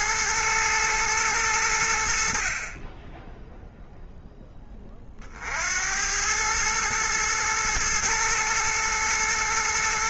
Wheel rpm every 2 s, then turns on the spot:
110, 40, 10, 110, 110.
none